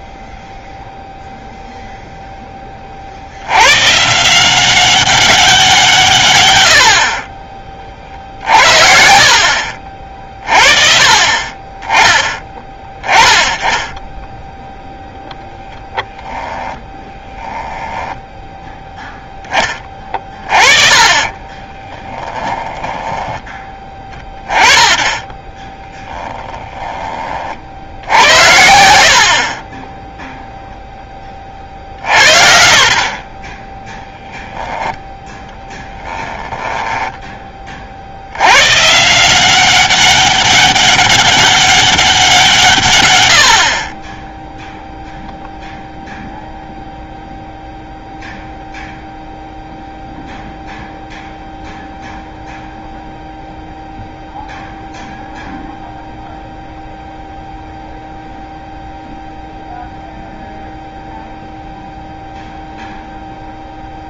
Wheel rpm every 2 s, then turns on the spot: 0, 30, 190, 90, 60, 40, 20, 0, 10, 0, 30, 10, 20, 10, 80, 0, 50, 10, 10, 120, 200, 150, 0, 0, 0, 0, 0, 0, 0, 0, 0, 0.
8-10 16-18 22-24 36-38